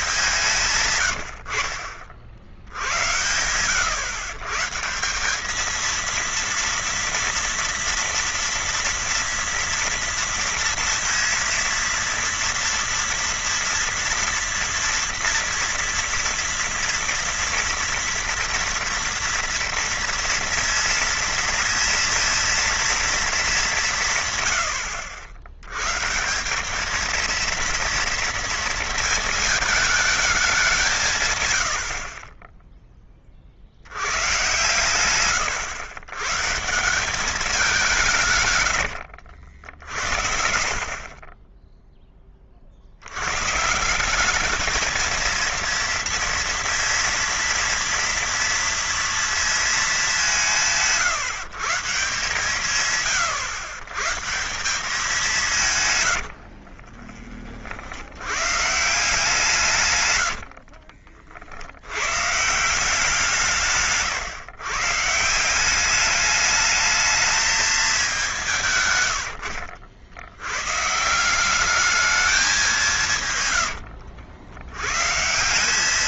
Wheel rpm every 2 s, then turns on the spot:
140, 80, 150, 230, 230, 230, 230, 230, 230, 230, 230, 230, 110, 200, 230, 190, 20, 110, 150, 100, 60, 40, 210, 230, 230, 170, 130, 180, 60, 140, 60, 160, 130, 210, 150, 120, 190, 90.
0-2 38-40 56-58 60-62